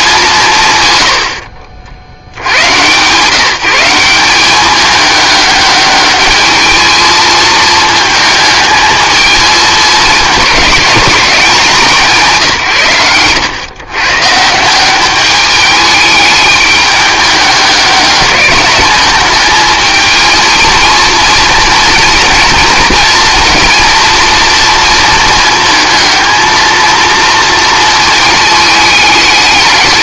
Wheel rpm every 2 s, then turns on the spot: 140, 120, 200, 220, 220, 220, 140, 160, 210, 210, 220, 230, 230, 230, 220.
none